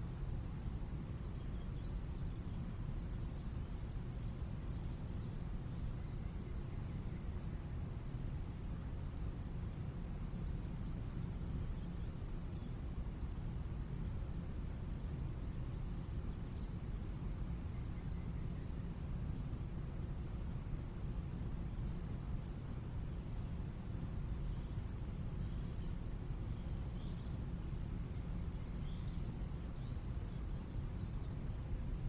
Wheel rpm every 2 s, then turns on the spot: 0, 0, 0, 0, 0, 0, 0, 0, 0, 0, 0, 0, 0, 0, 0, 0.
none